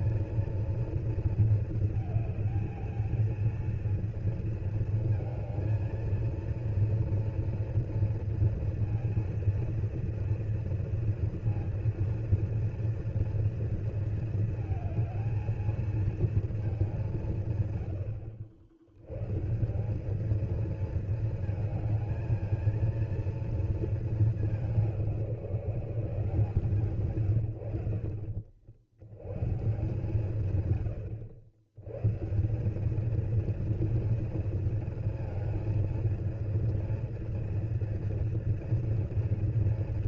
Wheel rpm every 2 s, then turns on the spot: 230, 220, 220, 230, 230, 230, 230, 220, 210, 80, 220, 230, 190, 150, 70, 110, 200, 230, 230, 230.
none